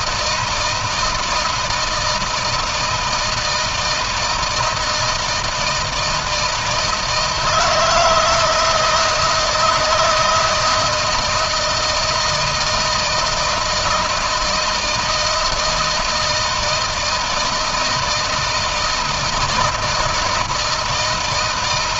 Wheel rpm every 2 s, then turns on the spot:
160, 160, 160, 160, 160, 160, 160, 160, 160, 160, 160.
none